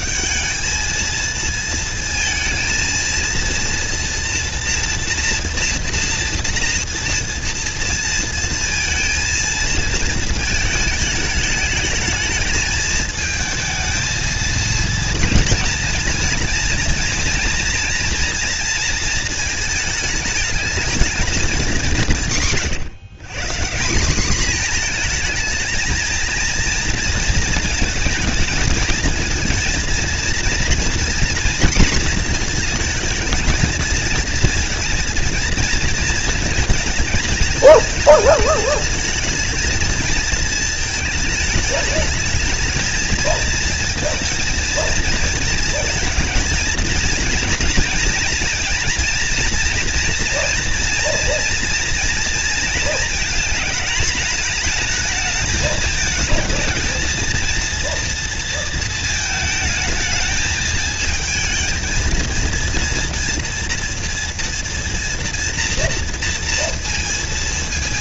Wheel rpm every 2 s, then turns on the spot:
210, 230, 230, 230, 230, 220, 220, 220, 230, 230, 210, 160, 220, 230, 230, 230, 230, 230, 230, 220, 220, 220, 230, 230, 230, 240, 230, 220, 220, 230, 220, 230, 230, 230.
none